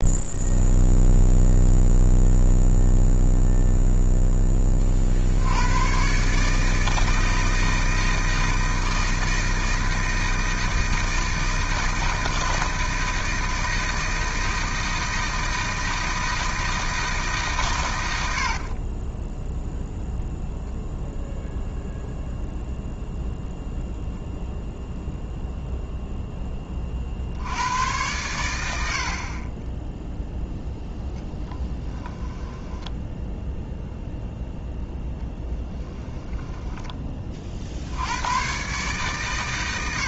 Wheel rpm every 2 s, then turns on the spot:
0, 0, 30, 160, 160, 160, 160, 160, 160, 40, 0, 0, 0, 30, 90, 0, 10, 0, 20, 130.
18-20 32-34